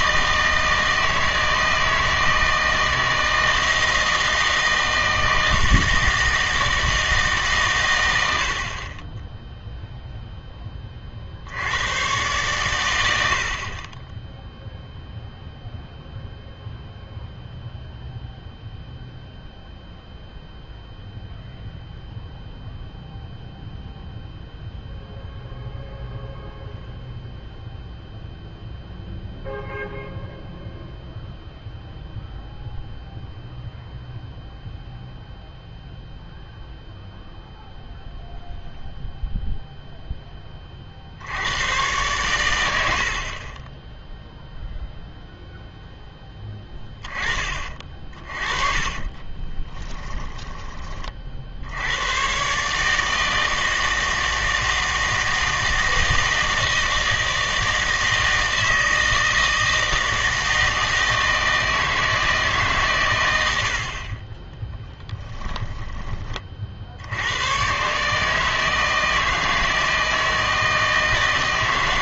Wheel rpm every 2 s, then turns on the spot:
160, 160, 160, 160, 60, 10, 120, 0, 0, 0, 0, 0, 0, 0, 0, 0, 0, 0, 0, 0, 20, 100, 0, 10, 30, 20, 140, 160, 160, 160, 160, 150, 10, 40, 160, 160.
48-50 64-66